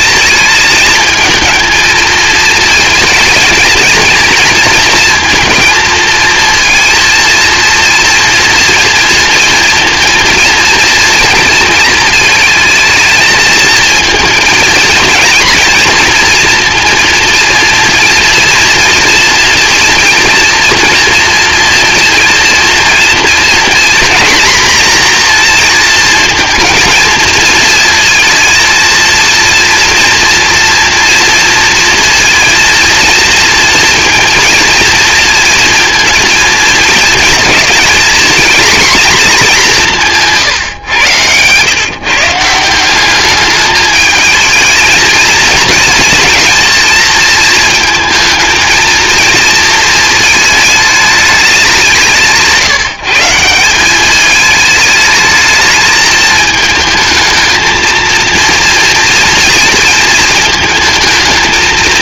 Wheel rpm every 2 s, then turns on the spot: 220, 230, 230, 230, 230, 230, 220, 230, 230, 240, 230, 230, 240, 230, 230, 230, 230, 230, 230, 240, 150, 160, 220, 230, 220, 220, 160, 210, 220, 230, 220.
none